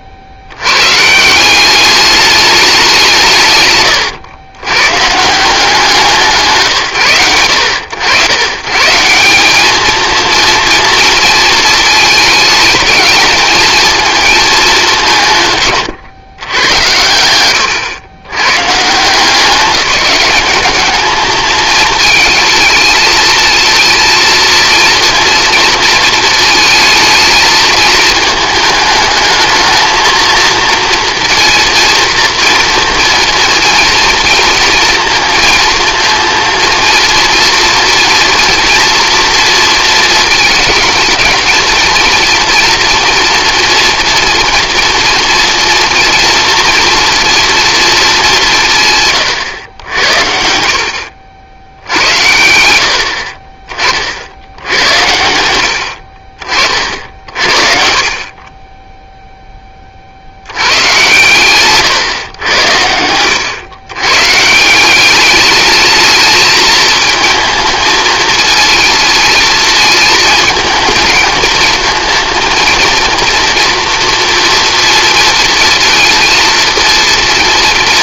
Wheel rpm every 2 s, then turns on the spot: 100, 200, 120, 150, 130, 230, 220, 200, 100, 130, 210, 220, 230, 220, 210, 230, 230, 230, 230, 240, 220, 240, 230, 230, 170, 70, 70, 90, 50, 20, 100, 100, 160, 220, 230, 220, 230, 230, 230.
none